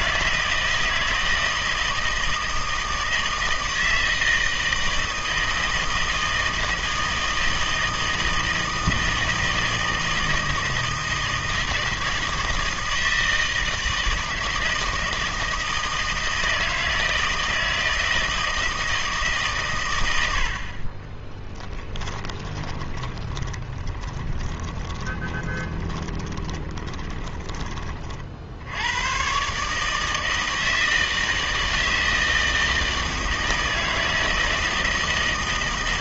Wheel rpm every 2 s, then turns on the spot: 160, 160, 160, 160, 160, 160, 160, 160, 160, 160, 50, 20, 20, 20, 80, 160, 160, 160.
22-28